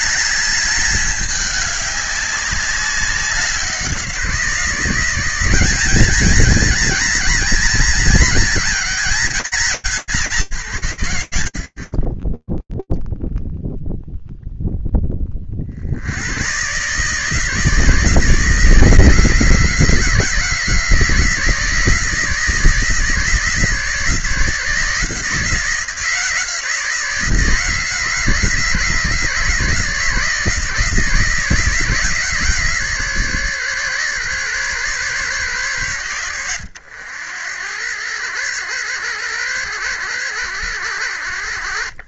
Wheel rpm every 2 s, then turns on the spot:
210, 190, 170, 200, 190, 160, 10, 0, 110, 160, 160, 160, 160, 170, 160, 160, 150, 130, 90, 100, 90.
none